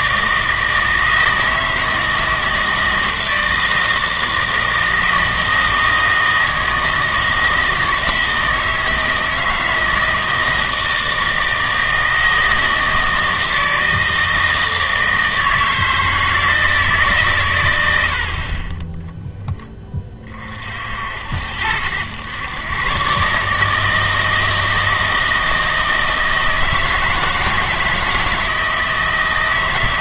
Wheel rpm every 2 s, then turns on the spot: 160, 160, 160, 160, 160, 160, 160, 160, 160, 20, 40, 120, 160, 160, 160.
none